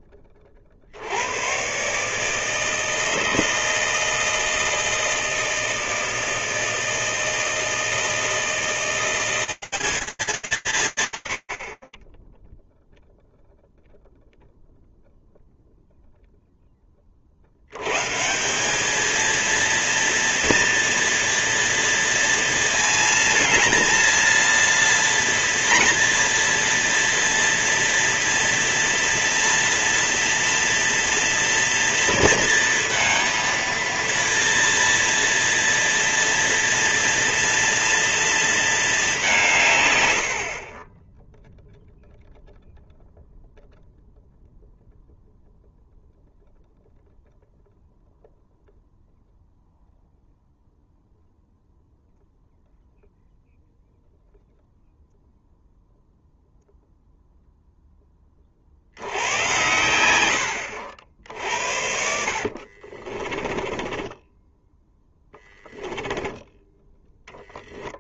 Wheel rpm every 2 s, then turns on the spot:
10, 140, 160, 160, 160, 200, 30, 0, 0, 170, 230, 230, 230, 230, 230, 230, 230, 230, 230, 230, 70, 0, 0, 0, 0, 0, 0, 0, 0, 90, 70, 30, 10, 10.
62-66